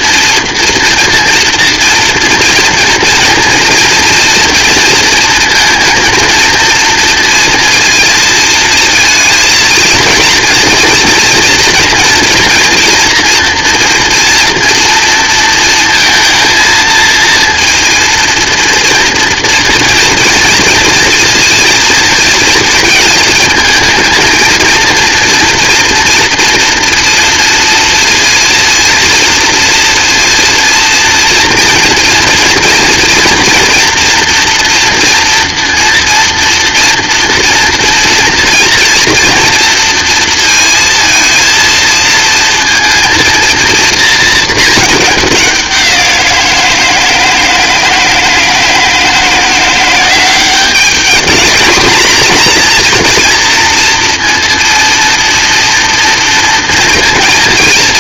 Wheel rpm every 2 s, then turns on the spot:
230, 230, 230, 230, 230, 230, 240, 230, 230, 240, 230, 220, 230, 230, 230, 230, 230, 240, 240, 230, 230, 230, 210, 160, 160, 210, 230, 230, 240.
none